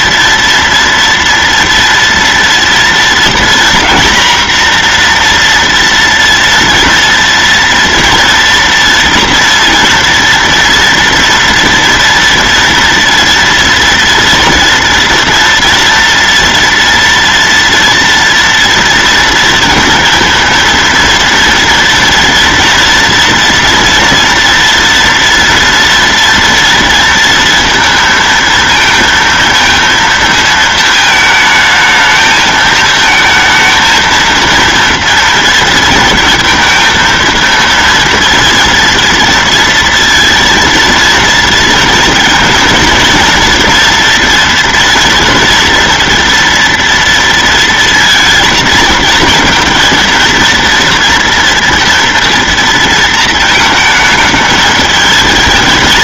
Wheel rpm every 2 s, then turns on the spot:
230, 240, 240, 240, 230, 230, 230, 230, 230, 230, 230, 240, 230, 230, 230, 220, 220, 230, 230, 230, 230, 230, 230, 230, 230, 230, 230, 220.
none